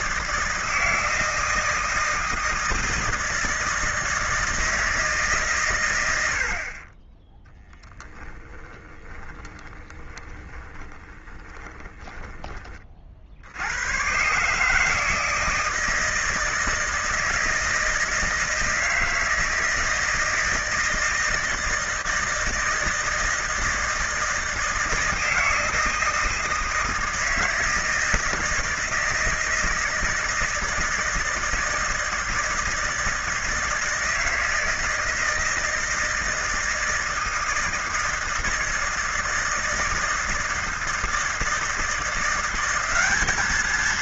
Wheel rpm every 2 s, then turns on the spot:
160, 160, 160, 70, 10, 20, 20, 130, 160, 160, 160, 160, 160, 160, 160, 160, 160, 160, 160, 160, 160, 170.
8-12